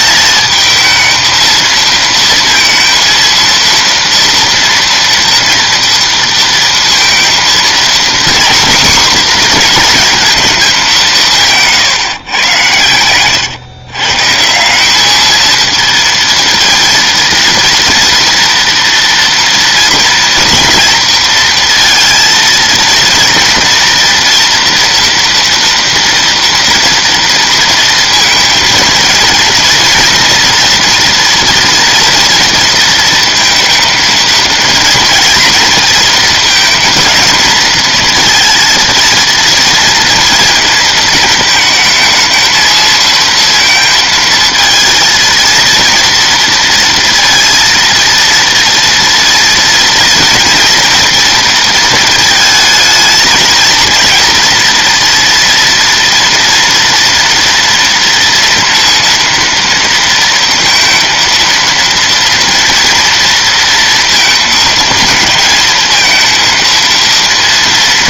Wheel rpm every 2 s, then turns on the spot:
220, 230, 240, 230, 250, 210, 110, 190, 230, 230, 230, 230, 240, 230, 230, 240, 230, 230, 220, 230, 230, 220, 230, 230, 230, 230, 220, 230, 230, 240, 230, 230, 220, 230.
none